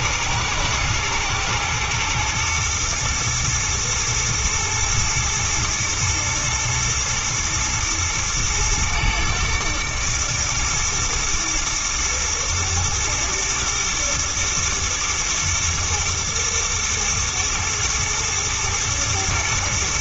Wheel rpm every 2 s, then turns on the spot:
110, 110, 110, 120, 120, 110, 120, 110, 110, 120.
none